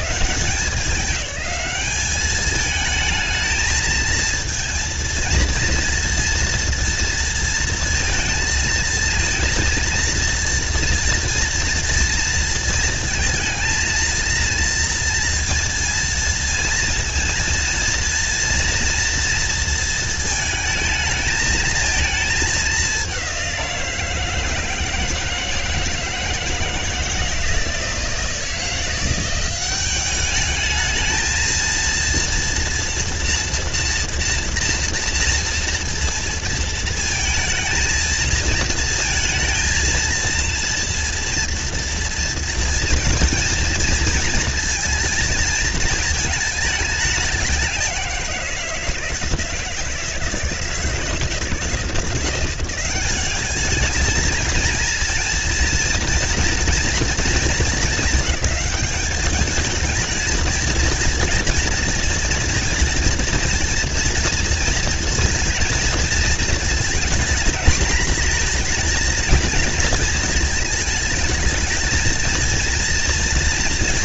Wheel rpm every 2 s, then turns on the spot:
180, 210, 230, 230, 230, 230, 230, 230, 230, 230, 220, 200, 160, 160, 170, 210, 230, 230, 230, 220, 230, 230, 230, 220, 170, 160, 180, 220, 240, 200, 230, 230, 230, 220, 230, 220, 230.
none